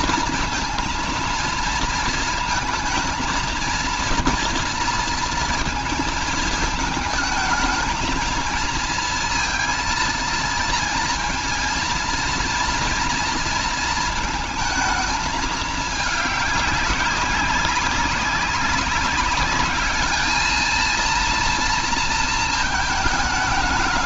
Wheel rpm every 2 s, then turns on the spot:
230, 230, 230, 220, 230, 230, 230, 220, 200, 190, 230, 220.
none